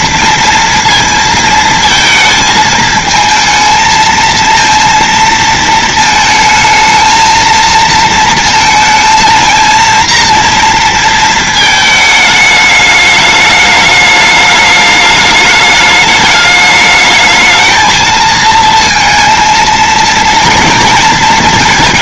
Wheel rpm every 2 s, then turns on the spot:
230, 220, 230, 220, 230, 230, 220, 210, 210, 230, 230.
none